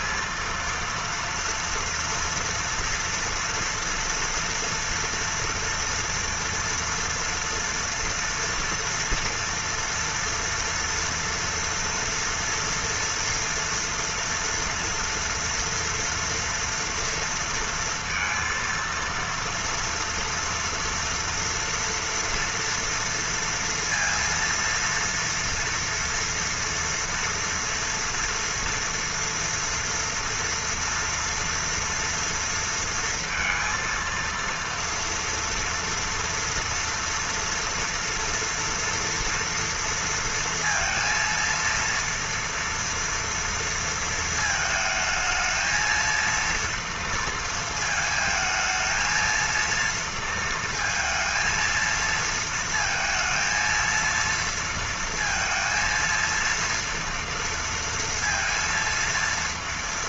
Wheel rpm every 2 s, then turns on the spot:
230, 230, 240, 230, 240, 230, 240, 230, 230, 230, 230, 230, 230, 230, 230, 230, 230, 230, 230, 230, 230, 230, 220, 230, 220, 230, 230, 230, 230, 230.
none